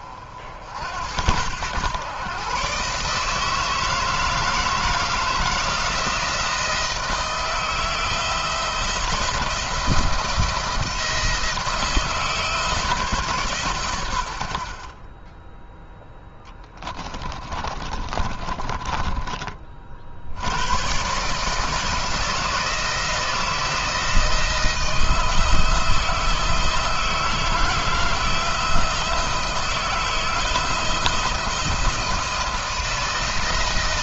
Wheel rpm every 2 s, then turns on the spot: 70, 140, 160, 160, 170, 160, 150, 60, 10, 20, 100, 170, 160, 160, 160, 160, 170.
16-20